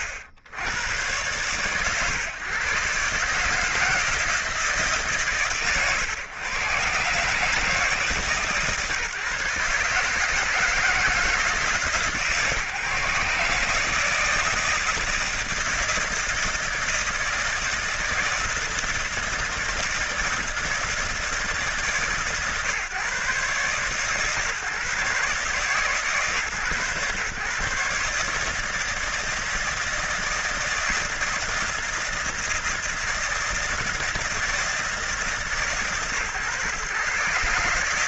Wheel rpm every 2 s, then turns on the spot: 60, 120, 150, 120, 150, 160, 150, 160, 160, 160, 160, 130, 140, 140, 150, 160, 160, 160, 130.
none